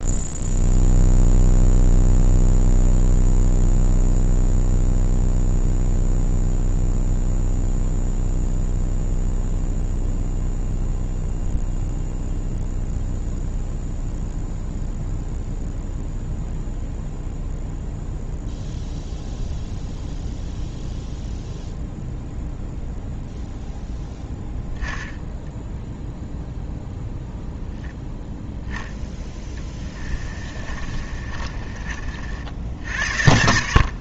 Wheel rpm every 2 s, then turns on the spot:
0, 0, 0, 0, 0, 0, 0, 0, 0, 0, 0, 0, 0, 0, 0, 40, 70.
30-32